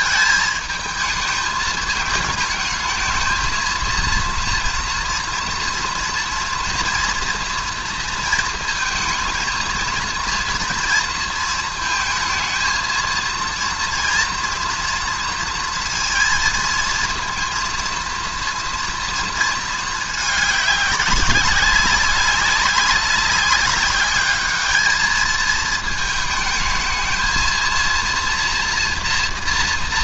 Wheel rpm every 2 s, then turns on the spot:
220, 210, 230, 230, 230, 240, 220, 230, 230, 240, 210, 200, 210, 220, 240.
none